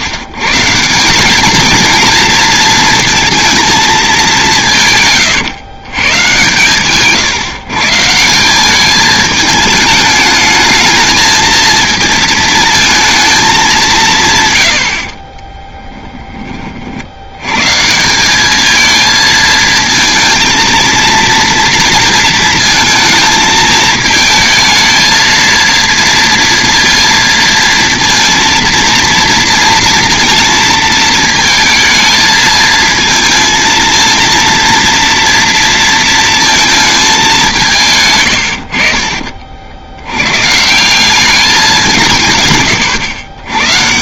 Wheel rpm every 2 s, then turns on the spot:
140, 230, 180, 140, 190, 210, 220, 120, 30, 210, 220, 230, 220, 230, 230, 230, 220, 230, 220, 80, 140, 120.
38-40